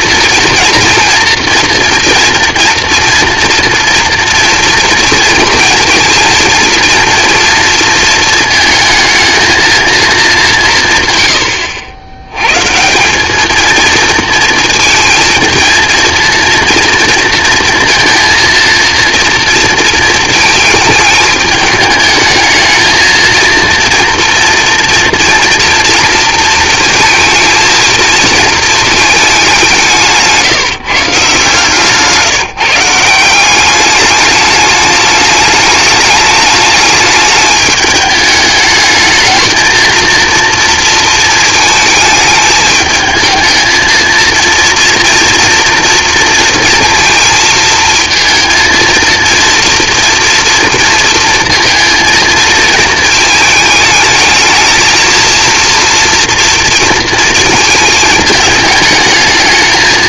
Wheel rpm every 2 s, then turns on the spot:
230, 230, 230, 230, 220, 160, 130, 230, 230, 230, 220, 220, 240, 230, 230, 150, 160, 210, 210, 210, 230, 220, 230, 230, 230, 230, 220, 220, 230, 220.
none